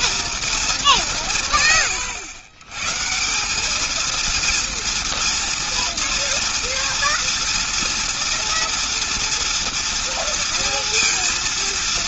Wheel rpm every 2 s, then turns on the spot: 180, 130, 230, 230, 240, 230.
none